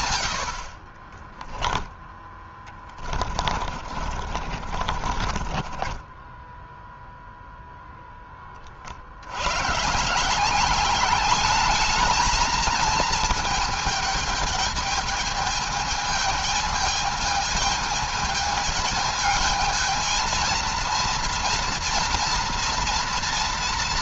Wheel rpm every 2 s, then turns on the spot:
40, 20, 50, 0, 60, 200, 220, 210, 220, 220, 230, 230.
0-6